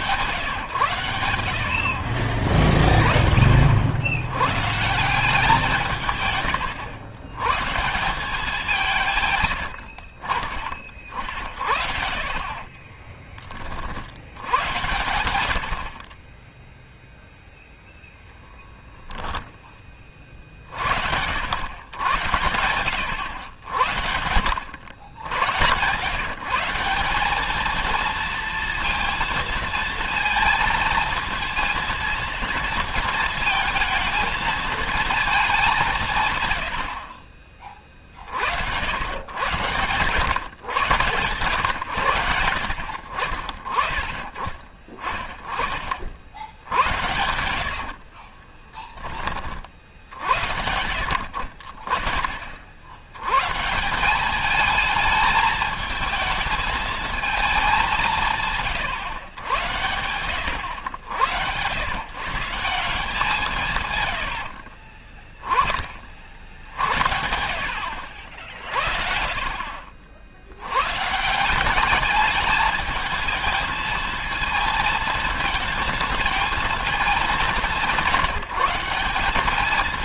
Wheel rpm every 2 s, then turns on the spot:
120, 30, 110, 110, 180, 40, 30, 90, 10, 10, 40, 80, 70, 160, 230, 220, 230, 220, 90, 70, 130, 90, 30, 70, 30, 80, 50, 210, 220, 140, 90, 160, 70, 70, 60, 90, 210, 220, 220, 180.
12-14 64-66